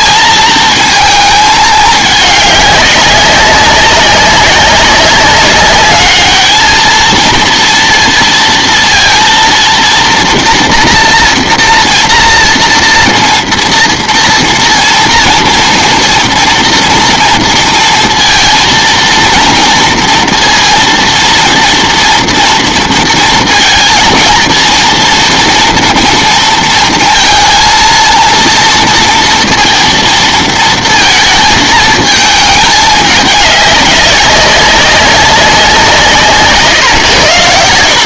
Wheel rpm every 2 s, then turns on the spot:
220, 200, 200, 220, 230, 230, 230, 230, 230, 230, 230, 230, 230, 230, 230, 230, 210, 190, 140.
none